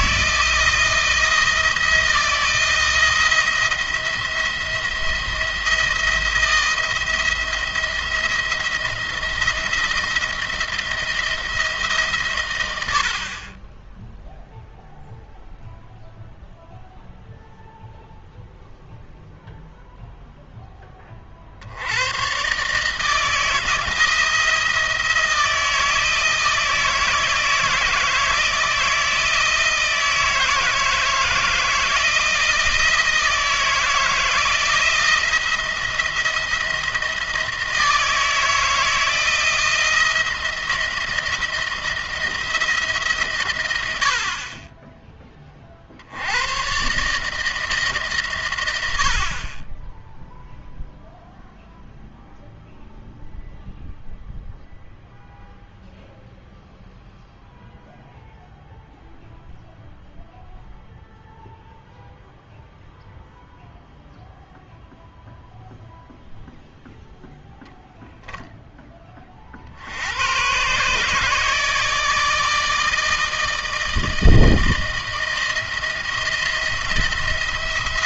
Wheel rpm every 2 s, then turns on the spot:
160, 170, 170, 170, 170, 170, 110, 0, 0, 0, 10, 140, 160, 160, 160, 160, 160, 160, 170, 160, 170, 170, 30, 110, 110, 0, 0, 0, 0, 0, 0, 0, 0, 0, 10, 130, 160, 160, 170.
none